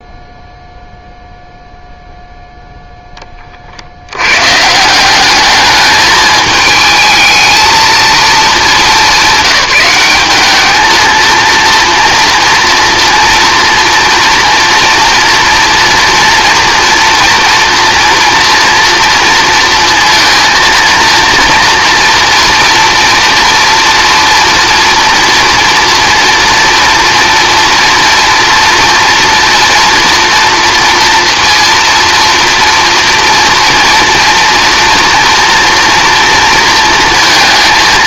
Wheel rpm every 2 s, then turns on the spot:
0, 0, 160, 220, 200, 210, 240, 230, 230, 230, 230, 230, 230, 230, 230, 230, 230, 230, 230.
none